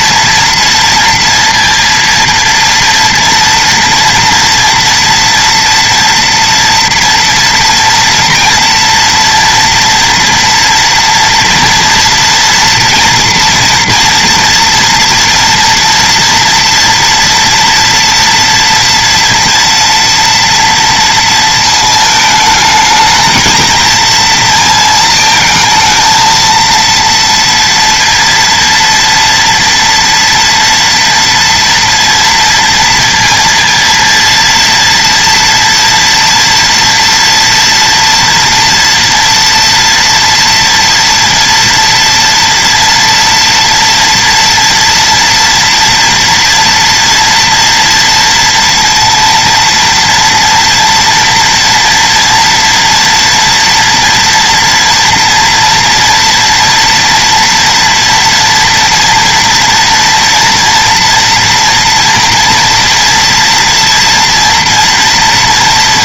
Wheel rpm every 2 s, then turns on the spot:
230, 230, 230, 230, 230, 230, 230, 230, 230, 240, 230, 220, 220, 230, 230, 230, 230, 230, 230, 230, 230, 230, 230, 230, 230, 240, 230, 230, 230, 230, 230, 230, 230.
none